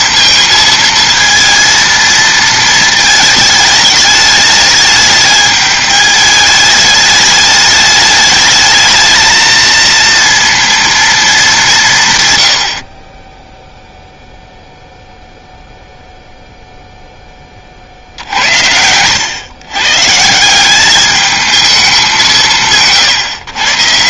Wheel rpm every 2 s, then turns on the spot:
220, 220, 210, 210, 220, 230, 40, 0, 0, 80, 190, 170.
none